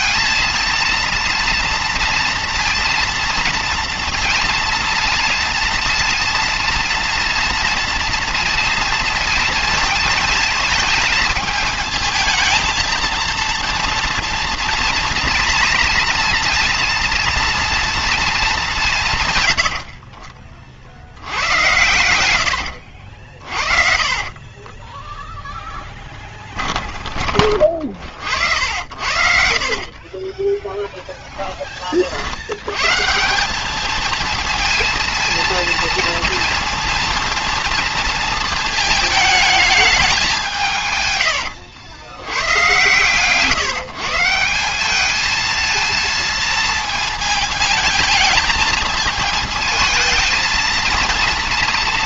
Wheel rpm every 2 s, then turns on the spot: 230, 230, 230, 230, 230, 220, 220, 230, 230, 190, 40, 90, 40, 20, 70, 10, 100, 230, 230, 220, 160, 110, 180, 220, 220, 230.
22-28 30-32